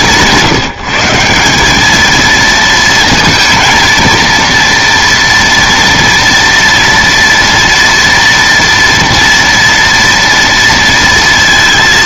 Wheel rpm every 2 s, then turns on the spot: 160, 230, 230, 230, 230, 230.
none